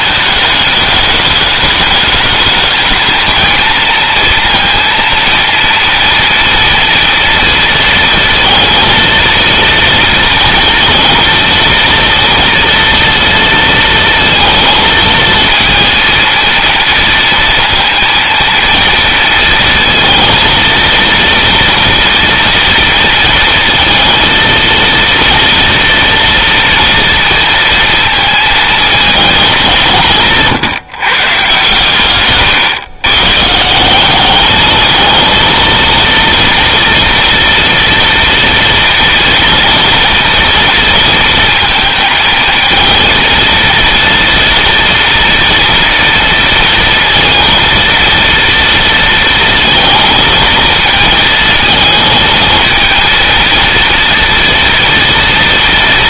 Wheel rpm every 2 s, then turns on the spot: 210, 220, 230, 230, 230, 230, 230, 230, 230, 230, 230, 230, 230, 230, 210, 140, 130, 220, 230, 230, 230, 230, 230, 230, 230, 220, 220, 230.
none